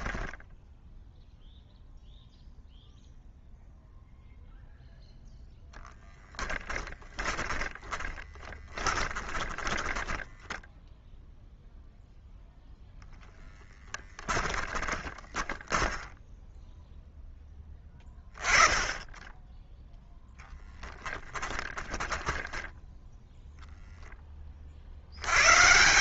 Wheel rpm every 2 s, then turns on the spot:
10, 0, 0, 10, 30, 10, 0, 20, 0, 20, 10, 10, 50.
6-10 14-16